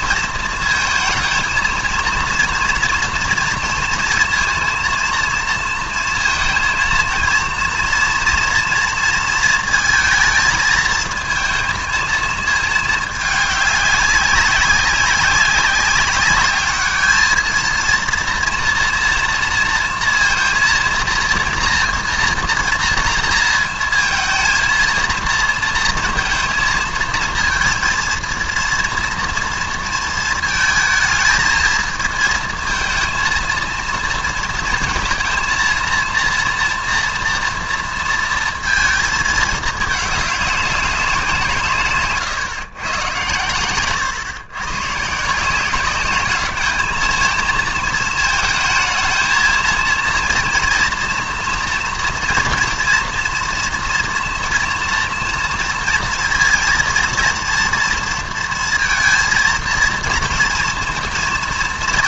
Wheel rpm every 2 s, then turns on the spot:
220, 230, 230, 230, 230, 220, 220, 200, 210, 230, 230, 230, 230, 220, 230, 220, 230, 220, 230, 230, 210, 140, 120, 210, 220, 230, 240, 230, 230, 230, 230.
none